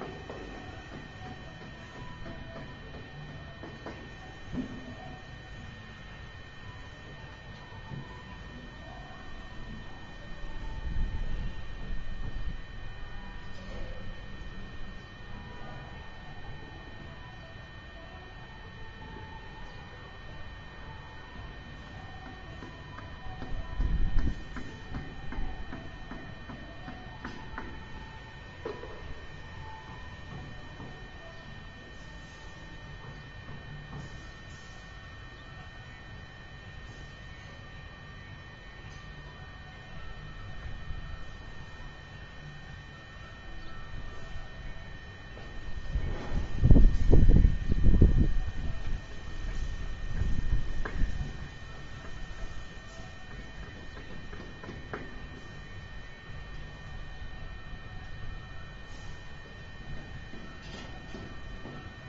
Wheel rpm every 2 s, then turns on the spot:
0, 0, 0, 0, 0, 0, 0, 0, 0, 0, 0, 0, 0, 0, 0, 0, 0, 0, 0, 0, 0, 0, 0, 0, 0, 0, 0, 0, 0, 0, 0.
none